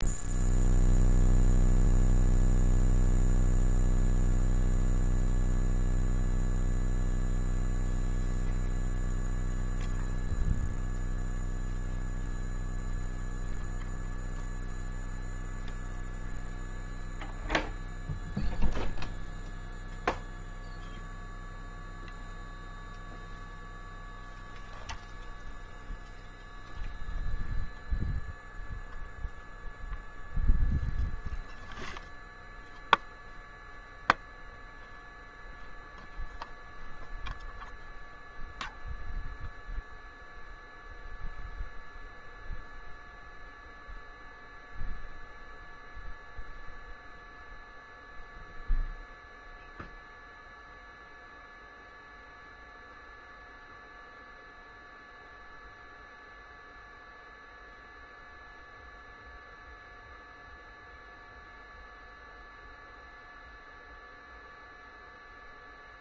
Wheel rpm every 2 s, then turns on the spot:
0, 0, 0, 0, 0, 0, 0, 0, 0, 0, 0, 0, 0, 0, 0, 0, 0, 0, 0, 0, 0, 0, 0, 0, 0, 0, 0, 0, 0, 0, 0, 0, 0.
none